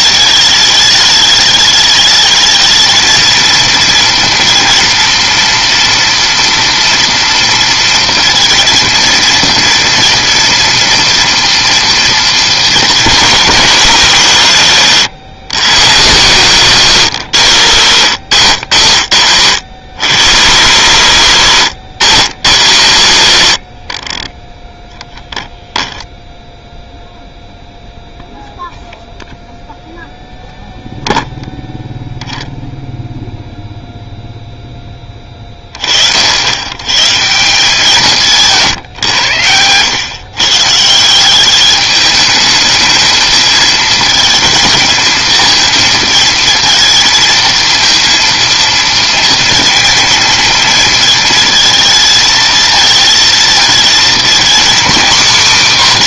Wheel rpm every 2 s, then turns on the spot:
210, 220, 230, 230, 230, 230, 230, 160, 160, 90, 110, 100, 10, 0, 0, 0, 0, 10, 80, 150, 140, 220, 220, 220, 230, 220, 220, 250.
none